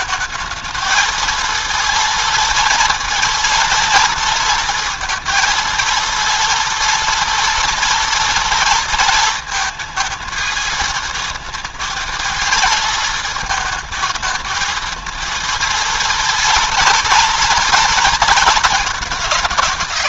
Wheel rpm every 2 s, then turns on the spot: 220, 230, 230, 230, 230, 220, 220, 230, 230, 220.
none